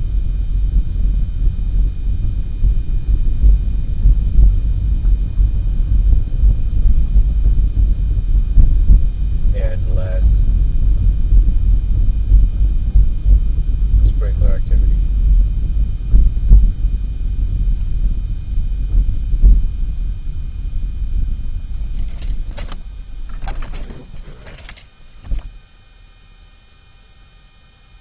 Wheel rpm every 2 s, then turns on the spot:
0, 0, 0, 0, 0, 0, 0, 0, 0, 0, 0, 0, 0, 0.
none